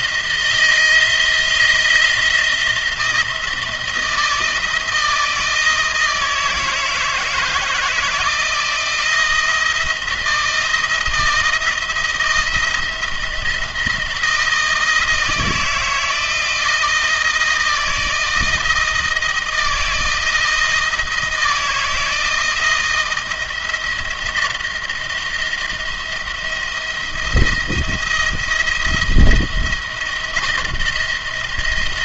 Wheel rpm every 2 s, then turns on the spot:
170, 170, 160, 160, 160, 170, 170, 170, 160, 160, 170, 160, 170, 170, 170, 170.
none